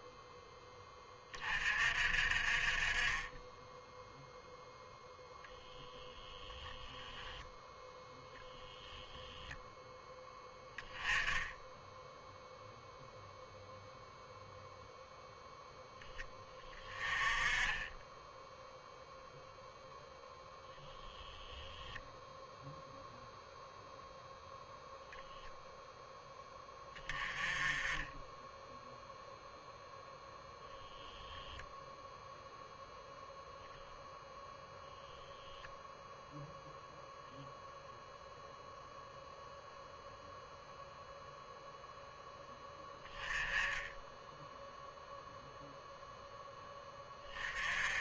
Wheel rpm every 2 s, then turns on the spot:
10, 20, 0, 0, 0, 10, 0, 0, 20, 0, 0, 0, 0, 20, 0, 0, 10, 0, 0, 0, 0, 10, 0, 20.
none